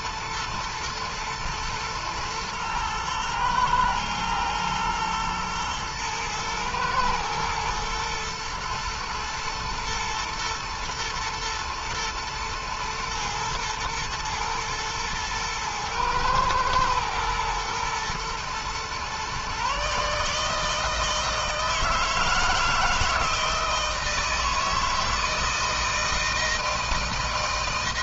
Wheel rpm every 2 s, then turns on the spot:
110, 110, 120, 110, 120, 110, 110, 110, 110, 120, 150, 160, 160, 160.
none